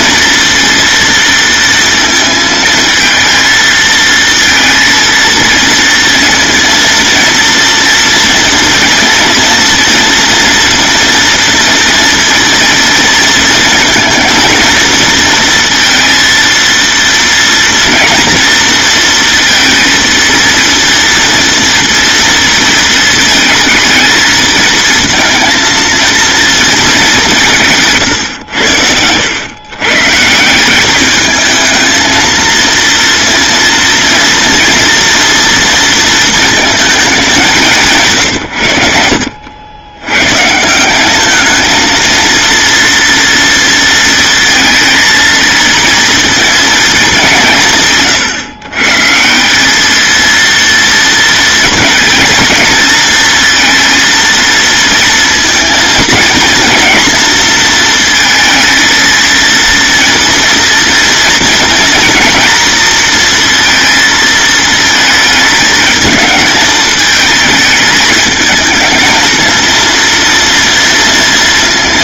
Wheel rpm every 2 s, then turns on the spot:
230, 220, 230, 230, 230, 230, 230, 230, 230, 230, 230, 220, 220, 210, 90, 200, 230, 230, 220, 80, 190, 230, 230, 220, 150, 230, 230, 230, 240, 230, 230, 230, 220, 220, 220, 230.
none